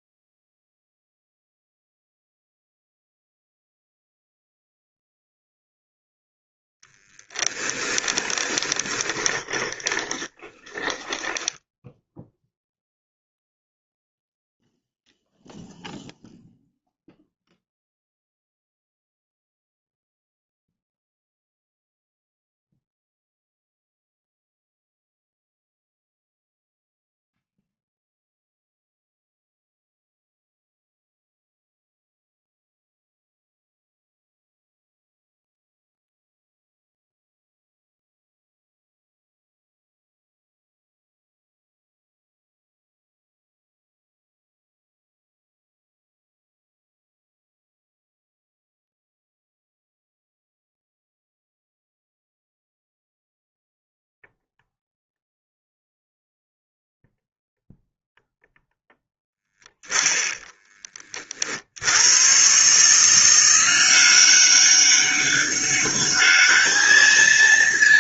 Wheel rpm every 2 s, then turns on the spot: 0, 0, 0, 0, 20, 20, 0, 0, 0, 0, 0, 0, 0, 0, 0, 0, 0, 0, 0, 0, 0, 0, 0, 0, 0, 0, 0, 0, 0, 0, 10, 140, 200, 210.
8-12